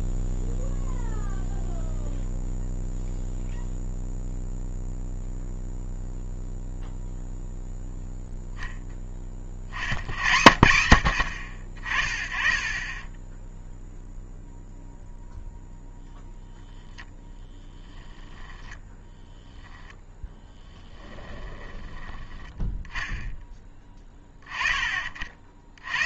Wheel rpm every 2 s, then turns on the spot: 0, 0, 0, 0, 0, 70, 20, 0, 0, 10, 20, 10, 30.
18-22